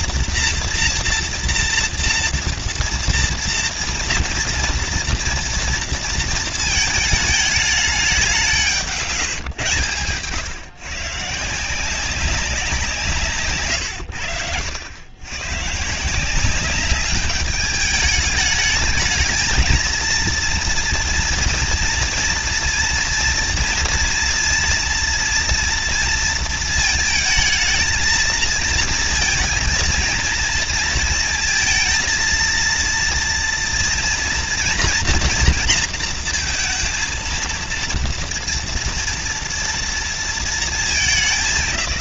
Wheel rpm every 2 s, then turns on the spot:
240, 240, 230, 220, 180, 130, 180, 80, 180, 210, 230, 230, 230, 230, 230, 230, 230, 230, 230, 230, 230.
none